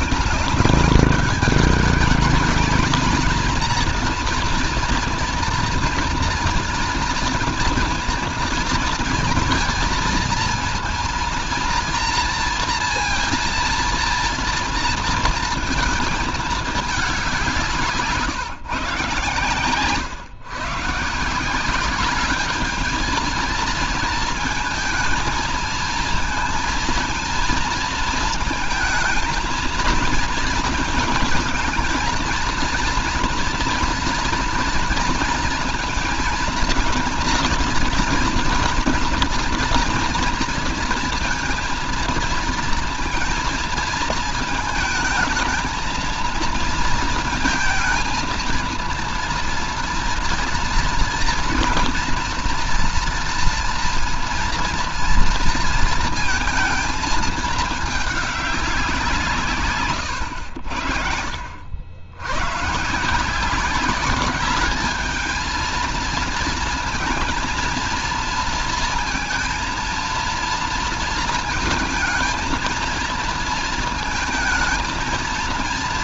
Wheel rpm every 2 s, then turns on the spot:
200, 220, 230, 240, 230, 230, 230, 230, 220, 140, 140, 210, 230, 230, 230, 230, 230, 230, 230, 230, 230, 230, 220, 230, 230, 230, 230, 230, 230, 200, 70, 120, 200, 230, 230, 230, 220, 220.
none